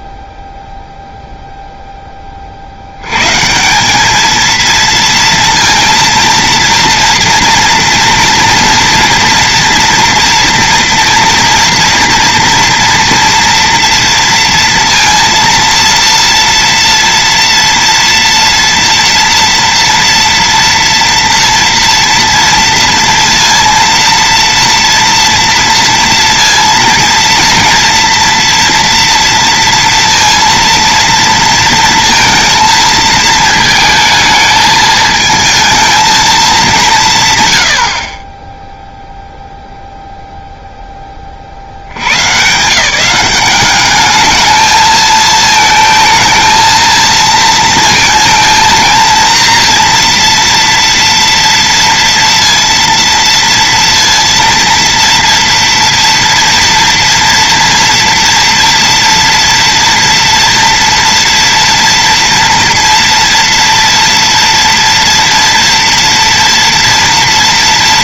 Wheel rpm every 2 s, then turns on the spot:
0, 50, 230, 230, 230, 230, 230, 230, 240, 240, 230, 230, 230, 230, 240, 230, 220, 220, 190, 10, 0, 140, 220, 220, 230, 240, 230, 230, 240, 230, 230, 230, 230, 230.
none